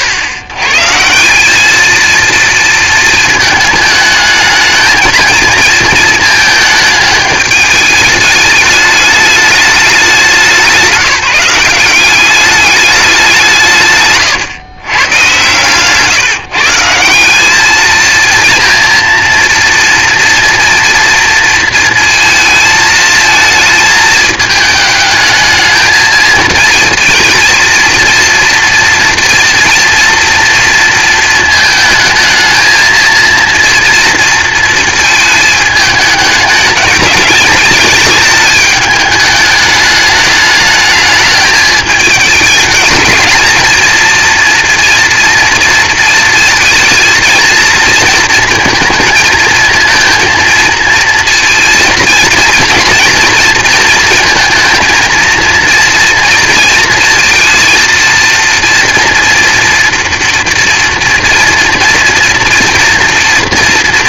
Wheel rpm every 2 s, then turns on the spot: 130, 230, 220, 220, 210, 180, 210, 130, 170, 230, 230, 230, 220, 220, 230, 230, 220, 230, 210, 210, 210, 220, 230, 230, 230, 220, 230, 220, 230, 230, 240, 240.
none